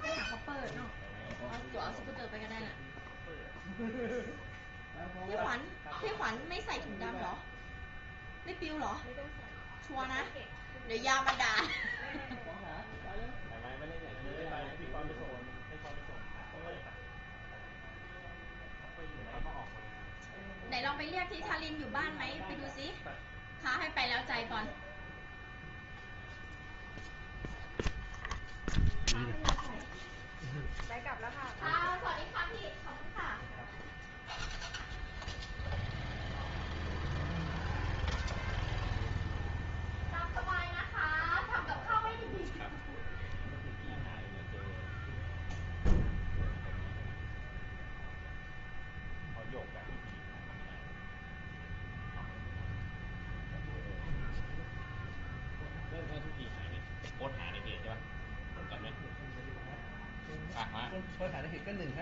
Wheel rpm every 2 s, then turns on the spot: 0, 0, 0, 0, 0, 0, 0, 0, 0, 0, 0, 0, 0, 0, 0, 0, 0, 0, 0, 0, 0, 0, 0, 0, 0, 0, 0, 0, 0, 0, 0.
none